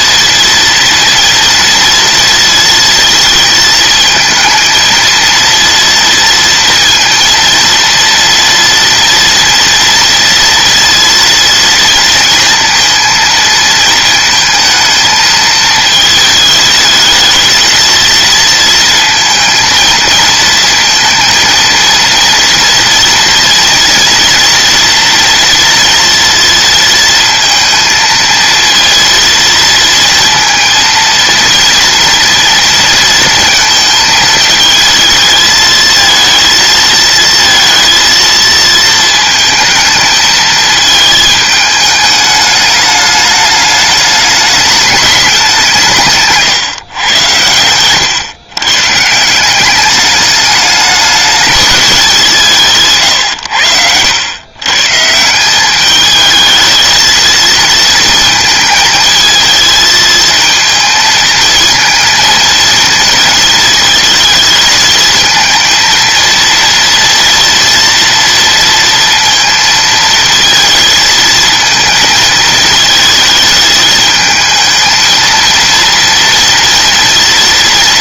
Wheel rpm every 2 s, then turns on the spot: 230, 230, 230, 230, 230, 230, 230, 220, 220, 230, 230, 230, 230, 230, 230, 230, 230, 220, 230, 220, 220, 210, 210, 130, 120, 210, 160, 130, 220, 220, 220, 230, 220, 230, 230, 230, 220, 220, 230.
none